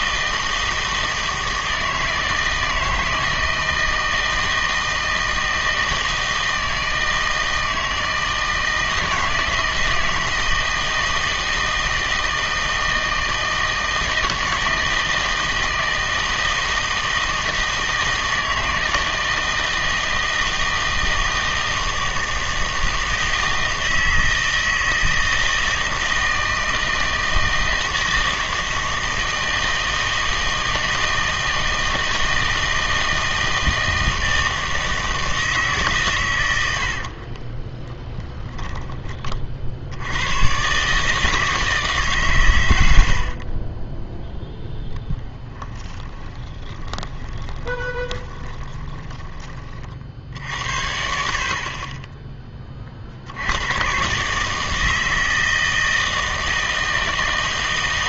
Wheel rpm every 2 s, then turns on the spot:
160, 160, 160, 160, 160, 160, 160, 160, 160, 160, 160, 160, 160, 160, 160, 160, 160, 160, 110, 10, 110, 130, 10, 20, 20, 70, 20, 160, 160.
38-40 46-50